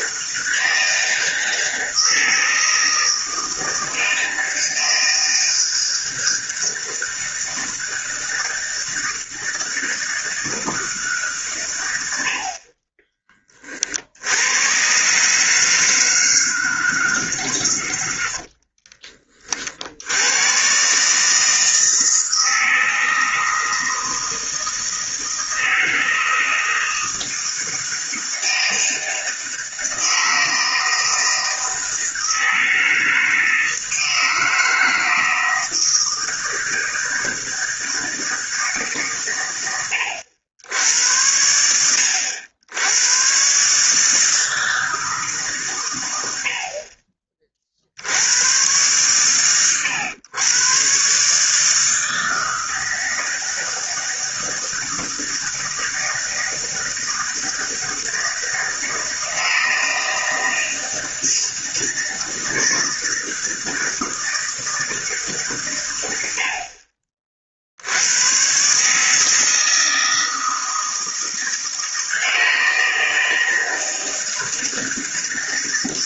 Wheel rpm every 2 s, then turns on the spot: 160, 160, 160, 160, 160, 160, 50, 90, 160, 60, 120, 160, 160, 160, 160, 160, 160, 160, 160, 160, 90, 80, 160, 70, 110, 110, 160, 160, 160, 160, 160, 160, 160, 70, 120, 160, 160, 160.
18-20